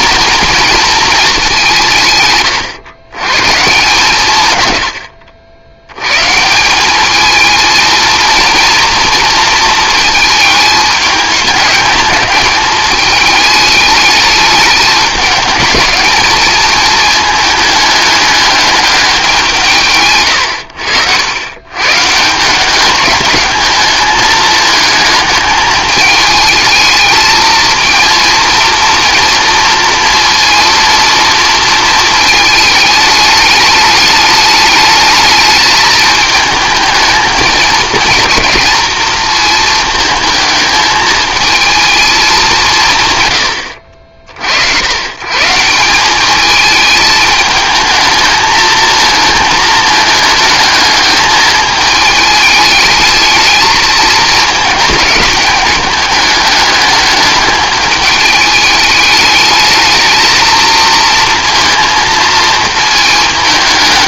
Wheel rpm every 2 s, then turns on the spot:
230, 120, 120, 180, 230, 210, 210, 210, 220, 210, 90, 180, 210, 220, 230, 230, 210, 210, 220, 220, 220, 190, 80, 220, 220, 220, 220, 220, 210, 210, 220, 220.
20-22